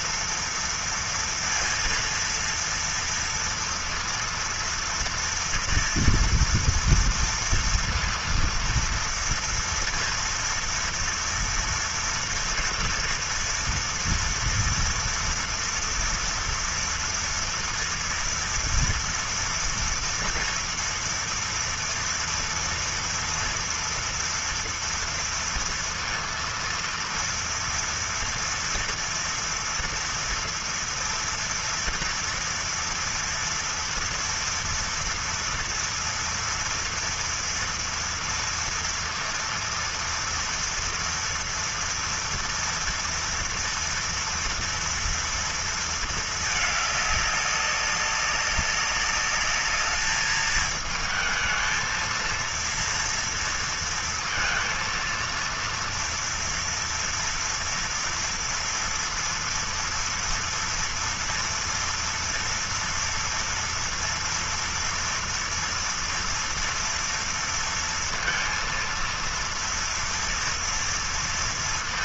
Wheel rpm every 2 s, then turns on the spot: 230, 230, 230, 230, 230, 230, 230, 230, 230, 230, 230, 230, 230, 230, 230, 230, 230, 230, 230, 230, 230, 230, 240, 210, 200, 220, 230, 230, 230, 230, 240, 230, 230, 230, 230, 230.
none